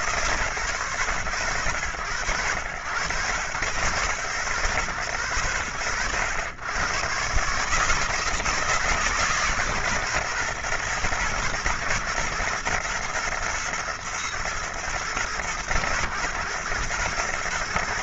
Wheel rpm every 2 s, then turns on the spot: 120, 100, 100, 110, 160, 120, 110, 110, 110.
none